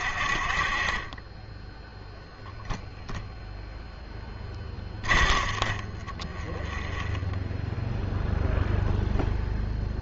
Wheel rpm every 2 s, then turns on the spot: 30, 0, 30, 0, 0.
4-6